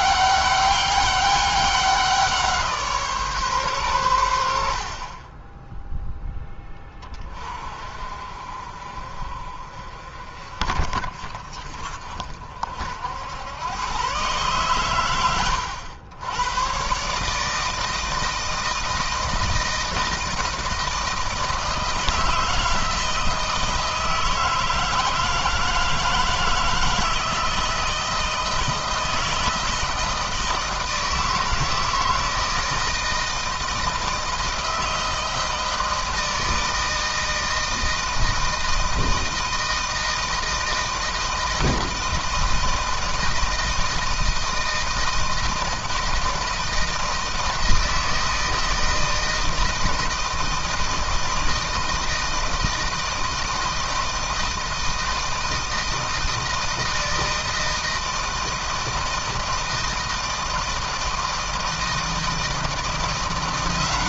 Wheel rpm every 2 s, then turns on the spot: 200, 160, 70, 20, 50, 40, 60, 120, 120, 160, 160, 160, 160, 160, 160, 160, 160, 160, 160, 160, 160, 160, 160, 160, 160, 160, 160, 160, 160, 160, 160, 170.
none